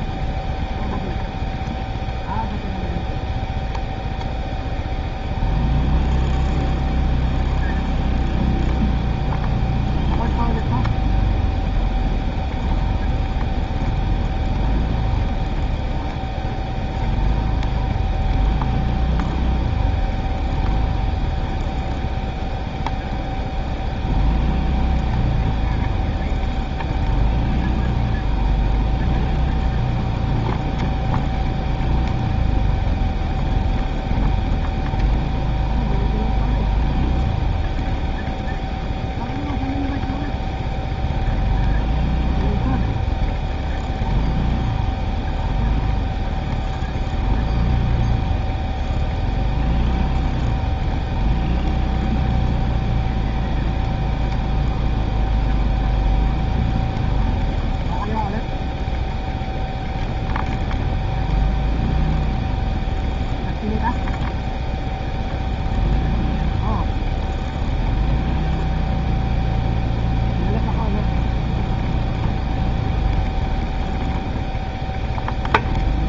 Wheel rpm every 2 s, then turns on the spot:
0, 0, 0, 0, 0, 0, 0, 0, 0, 0, 0, 0, 0, 0, 0, 0, 0, 0, 0, 0, 0, 0, 0, 0, 0, 0, 0, 0, 0, 0, 0, 0, 0, 0, 0, 0, 0, 0.
none